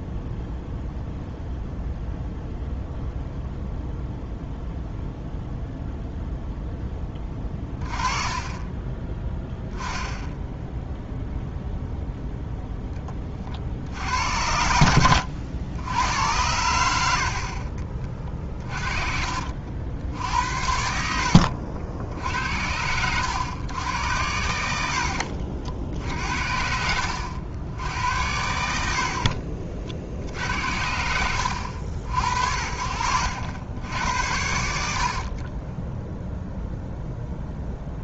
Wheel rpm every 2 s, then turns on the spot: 0, 0, 0, 10, 10, 0, 10, 90, 80, 40, 70, 90, 70, 70, 70, 80, 60, 70, 0.
18-20 24-26